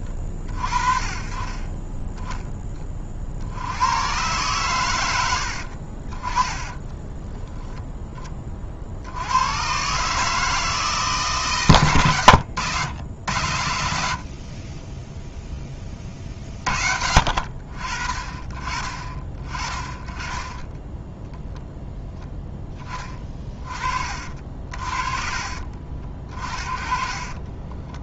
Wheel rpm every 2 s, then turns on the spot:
20, 10, 100, 50, 20, 150, 90, 70, 40, 30, 10, 10, 50, 30.
none